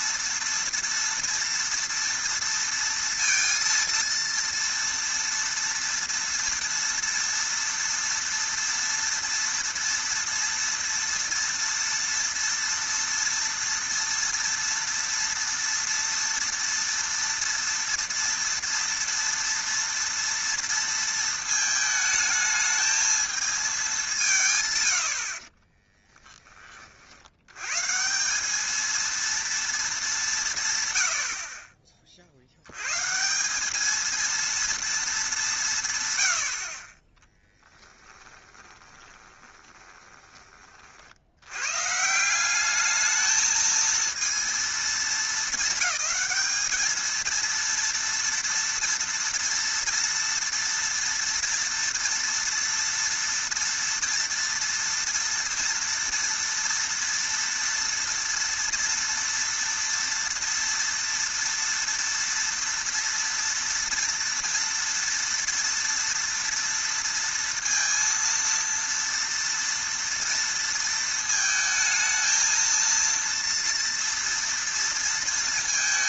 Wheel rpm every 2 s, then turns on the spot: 230, 230, 230, 230, 230, 230, 230, 230, 230, 230, 230, 220, 130, 30, 220, 140, 100, 230, 50, 20, 30, 200, 230, 220, 230, 230, 230, 230, 230, 230, 230, 230, 230, 230, 230, 230, 230, 230.
38-40